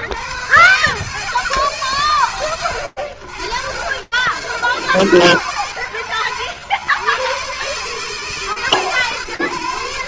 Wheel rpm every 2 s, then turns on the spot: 90, 120, 110, 150, 120.
none